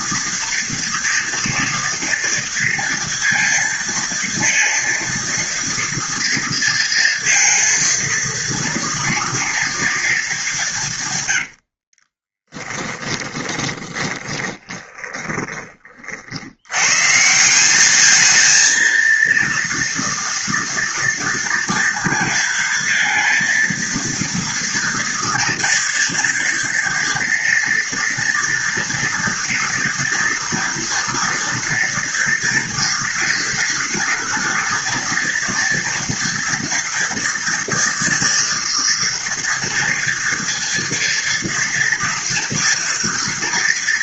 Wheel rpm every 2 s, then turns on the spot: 230, 230, 230, 230, 230, 200, 20, 20, 90, 220, 230, 230, 230, 240, 230, 230, 230, 230, 230, 230, 230, 230.
12-16